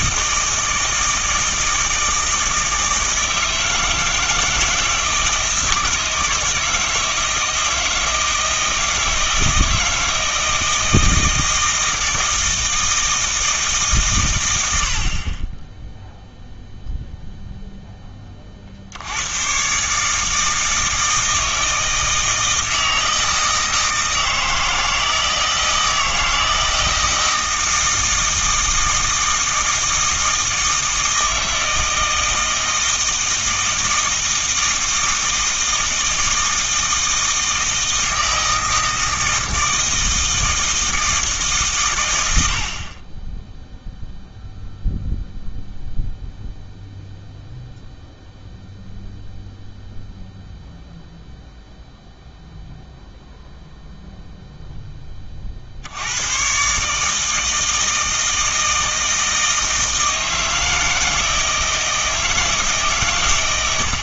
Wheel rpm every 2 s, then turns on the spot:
160, 160, 160, 160, 160, 160, 160, 90, 0, 50, 160, 160, 160, 160, 160, 160, 160, 160, 160, 160, 160, 60, 0, 0, 0, 0, 0, 0, 130, 160, 160, 150.
none